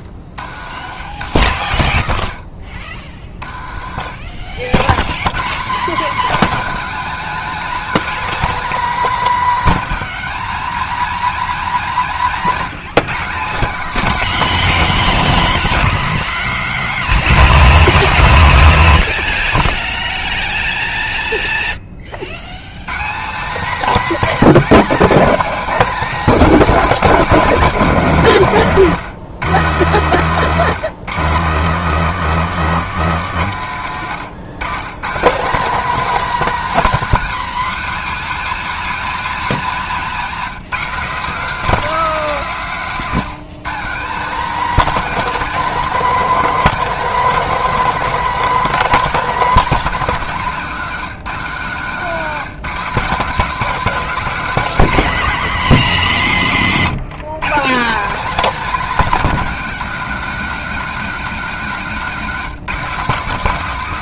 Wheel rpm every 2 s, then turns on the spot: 80, 50, 70, 260, 270, 230, 190, 230, 220, 140, 0, 130, 270, 260, 150, 160, 200, 130, 260, 260, 200, 200, 230, 260, 240, 170, 200, 230, 150, 230, 210, 200.
56-58